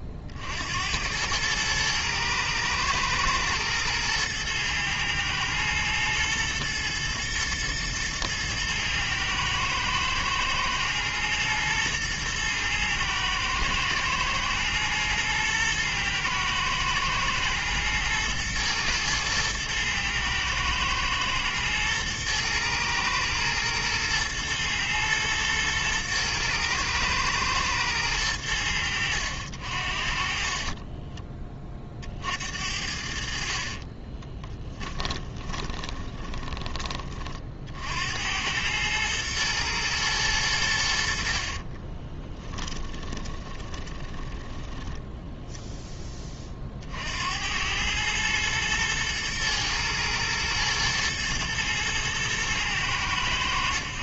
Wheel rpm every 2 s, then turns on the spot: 80, 110, 110, 110, 110, 110, 110, 110, 110, 110, 110, 110, 110, 110, 90, 30, 60, 20, 30, 110, 80, 10, 10, 50, 110, 110, 110.
30-32 34-36 42-44